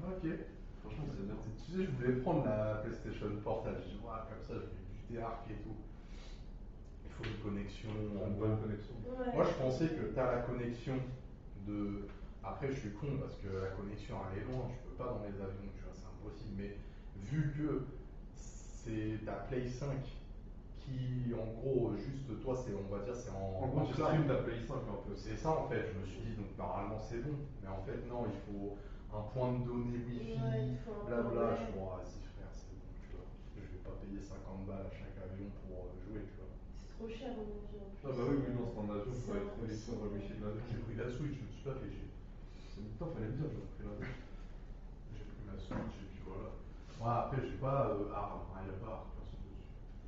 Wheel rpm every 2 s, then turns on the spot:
0, 0, 0, 0, 0, 0, 0, 0, 0, 0, 0, 0, 0, 0, 0, 0, 0, 0, 0, 0, 0, 0, 0, 0, 0.
none